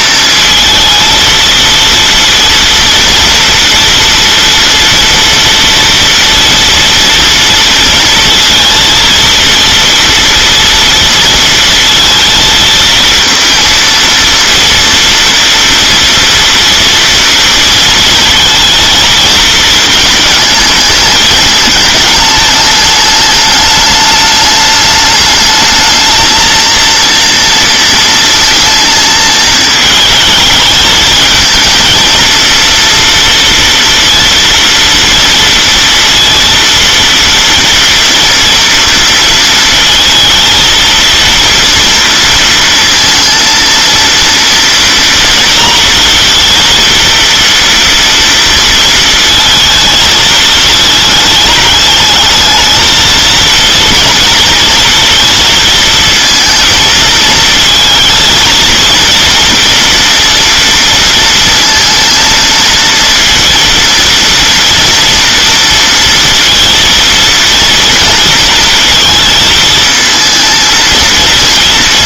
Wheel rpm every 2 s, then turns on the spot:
220, 230, 240, 230, 230, 230, 230, 230, 230, 230, 220, 210, 210, 230, 220, 210, 230, 230, 230, 230, 230, 230, 230, 230, 230, 220, 220, 240, 230, 230, 230, 230, 230, 230, 220, 230.
none